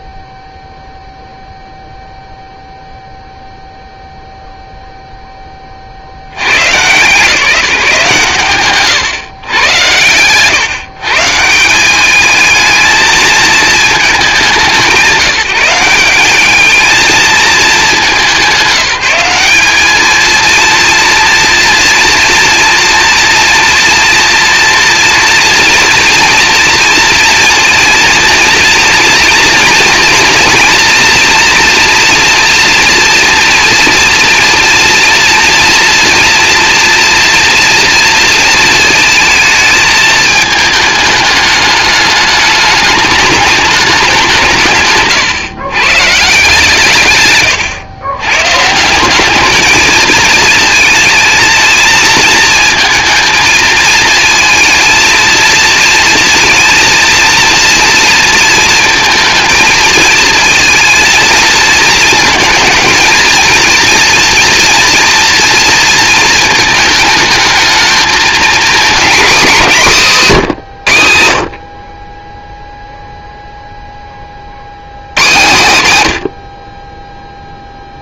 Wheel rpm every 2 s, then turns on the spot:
0, 0, 0, 130, 130, 140, 220, 180, 220, 190, 240, 230, 230, 230, 230, 230, 240, 230, 240, 220, 210, 210, 140, 150, 180, 220, 220, 230, 230, 230, 230, 220, 230, 220, 250, 140, 0, 90, 20.
none